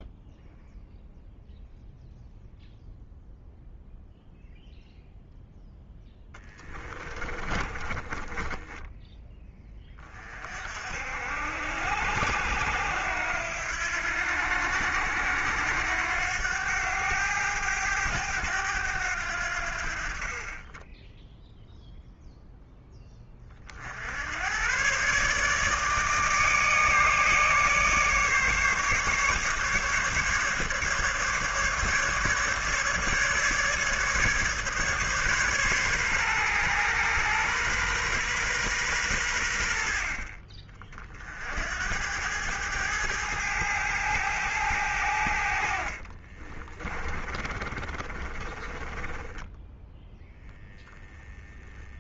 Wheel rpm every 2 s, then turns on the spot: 0, 0, 0, 20, 10, 60, 90, 90, 100, 90, 20, 10, 120, 150, 150, 150, 150, 140, 120, 110, 40, 110, 100, 40, 20, 0.
6-8 46-50